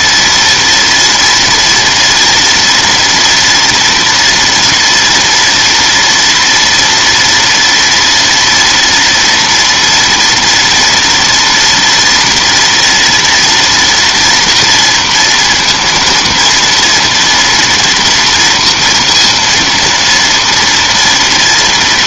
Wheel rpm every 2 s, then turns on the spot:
230, 230, 240, 230, 230, 230, 230, 230, 230, 230, 230.
none